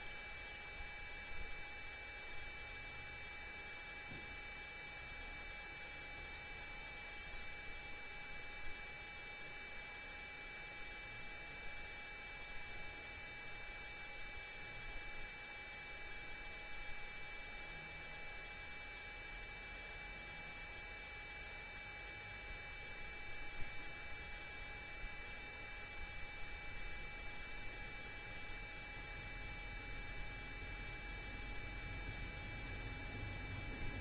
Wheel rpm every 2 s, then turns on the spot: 0, 0, 0, 0, 0, 0, 0, 0, 0, 0, 0, 0, 0, 0, 0, 0, 0.
none